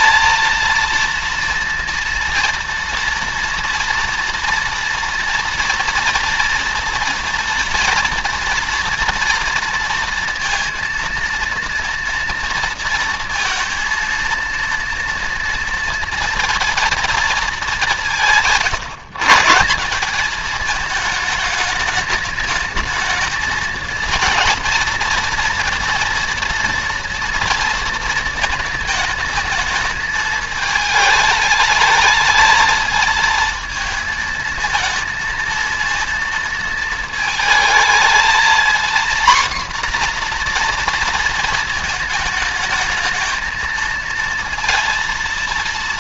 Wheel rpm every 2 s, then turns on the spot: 230, 230, 230, 230, 230, 230, 230, 230, 230, 150, 220, 220, 230, 230, 220, 210, 220, 230, 230, 240, 240, 220, 230.
none